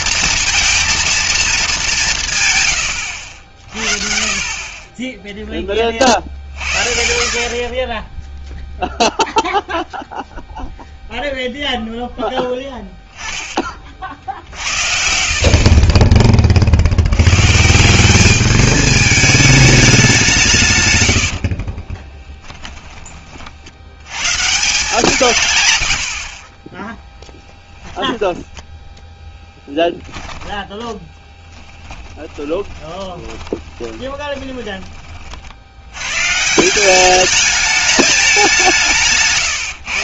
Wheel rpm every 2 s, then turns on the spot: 230, 120, 30, 50, 0, 0, 10, 60, 30, 210, 160, 20, 160, 30, 10, 10, 20, 20, 150, 190.
22-24 28-30 32-36